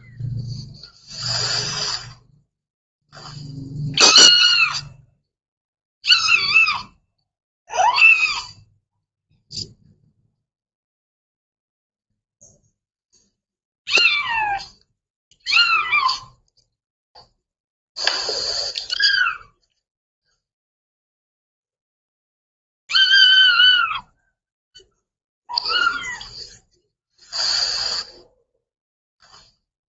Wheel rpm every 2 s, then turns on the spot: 0, 0, 0, 0, 0, 0, 0, 0, 0, 0, 0, 0, 0, 0, 0.
none